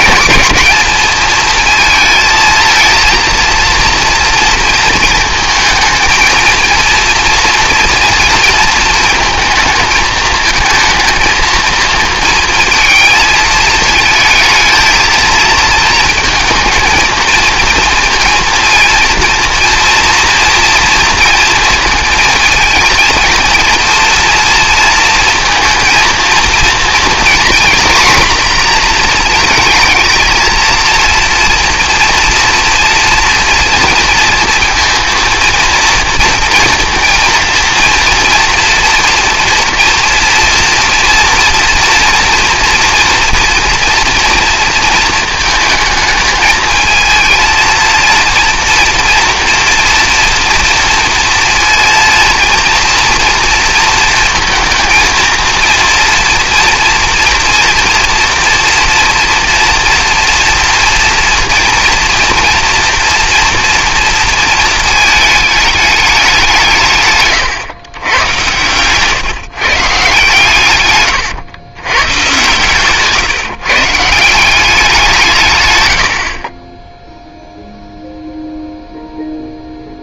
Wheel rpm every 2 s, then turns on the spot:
210, 230, 230, 230, 230, 220, 230, 220, 220, 230, 230, 220, 230, 230, 230, 220, 240, 230, 230, 230, 230, 240, 230, 220, 230, 230, 230, 230, 230, 230, 240, 230, 220, 170, 120, 120, 140, 190, 30, 0.
72-74